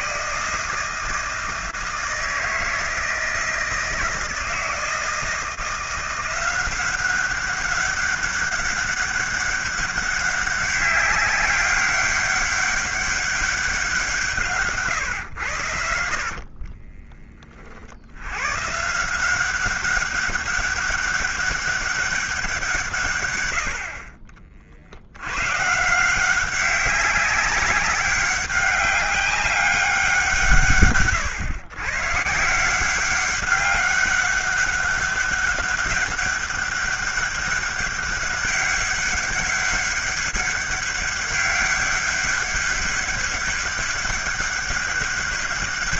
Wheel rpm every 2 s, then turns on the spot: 160, 160, 160, 180, 200, 190, 200, 140, 30, 140, 200, 160, 50, 200, 200, 140, 160, 200, 200, 200, 200, 200, 200.
14-18